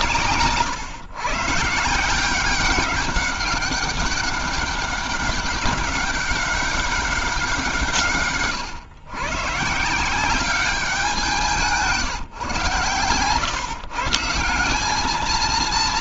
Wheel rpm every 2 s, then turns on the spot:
130, 190, 200, 200, 140, 190, 130, 190.
none